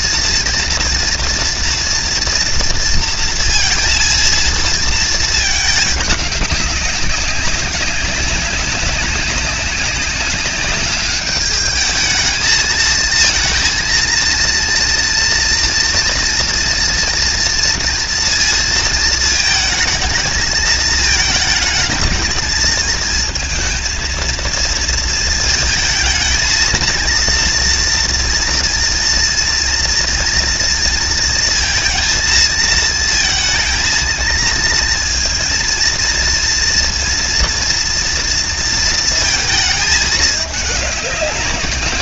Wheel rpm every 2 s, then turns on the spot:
230, 230, 220, 190, 190, 200, 220, 230, 230, 230, 220, 230, 230, 230, 230, 230, 220, 230, 230, 230, 200.
none